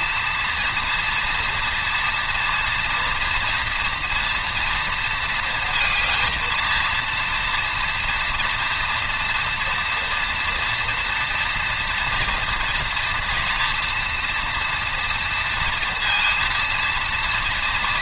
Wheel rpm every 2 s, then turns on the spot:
230, 240, 230, 230, 230, 230, 230, 240, 230.
none